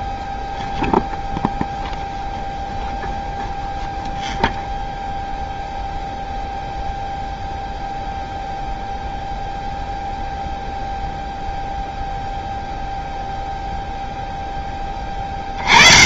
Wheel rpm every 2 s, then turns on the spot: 0, 0, 0, 0, 0, 0, 0, 0.
none